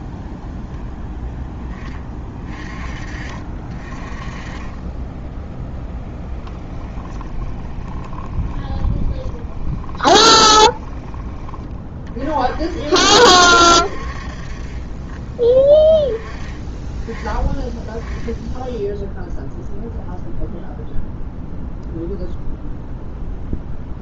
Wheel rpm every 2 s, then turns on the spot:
0, 30, 20, 10, 10, 10, 50, 40, 20, 10, 0, 0.
6-12